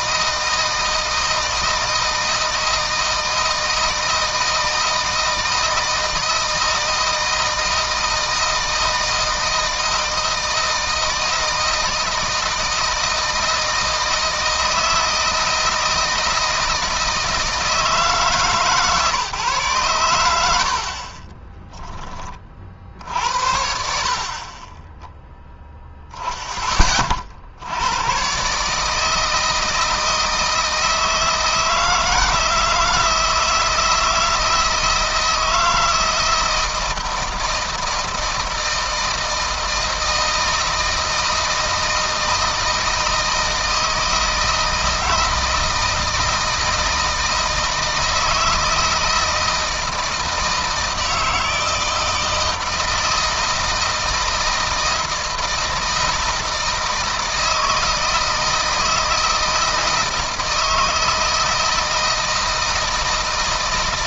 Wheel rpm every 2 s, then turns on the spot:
160, 160, 160, 160, 160, 160, 160, 160, 160, 140, 60, 50, 20, 20, 150, 160, 170, 160, 160, 160, 160, 160, 160, 160, 160, 160, 160, 160, 160, 160, 160, 160.
none